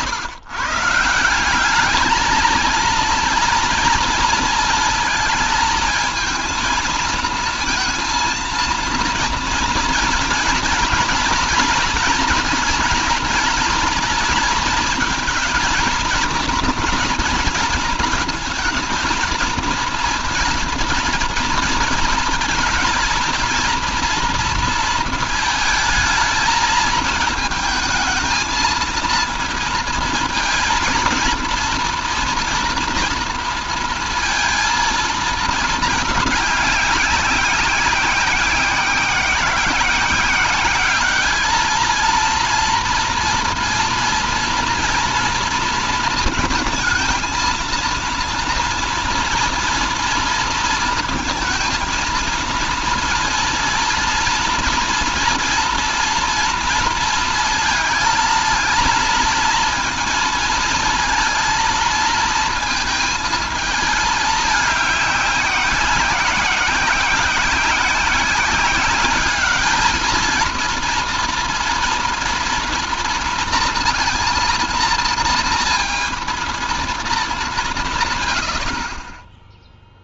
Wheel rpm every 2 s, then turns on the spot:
140, 230, 230, 230, 230, 230, 230, 240, 240, 220, 240, 230, 230, 220, 230, 230, 230, 230, 200, 180, 200, 230, 240, 230, 230, 230, 230, 230, 230, 230, 230, 220, 200, 180, 200, 230, 230, 230, 230, 50.
none